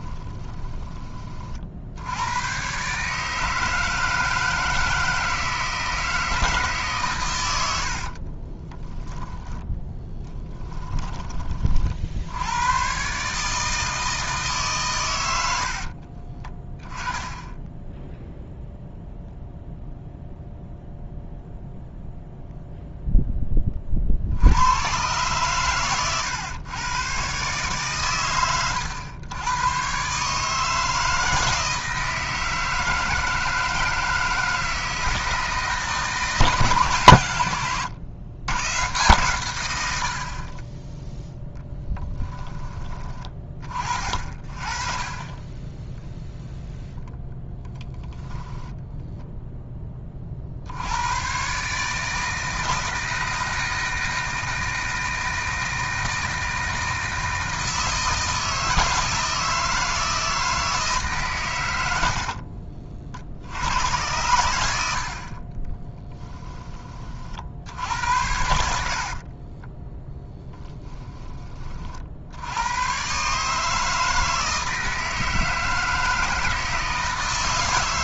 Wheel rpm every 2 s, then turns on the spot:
20, 130, 160, 150, 10, 10, 110, 130, 10, 0, 0, 0, 100, 120, 100, 160, 160, 160, 150, 120, 10, 20, 40, 0, 10, 80, 160, 160, 160, 160, 160, 50, 80, 30, 60, 10, 110, 160, 160.
0-2 8-10 48-50